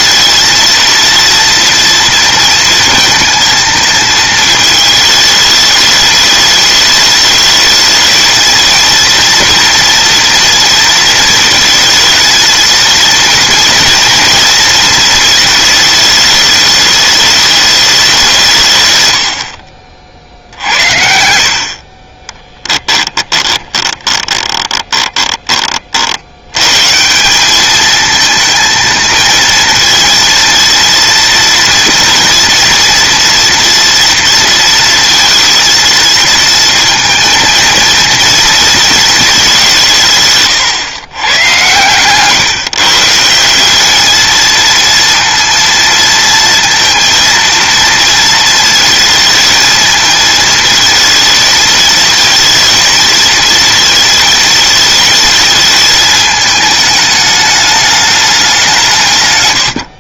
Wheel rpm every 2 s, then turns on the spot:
230, 230, 220, 210, 220, 230, 230, 230, 220, 200, 60, 40, 20, 60, 220, 230, 230, 230, 230, 230, 160, 130, 220, 230, 230, 220, 230, 230, 220, 210.
22-26 42-44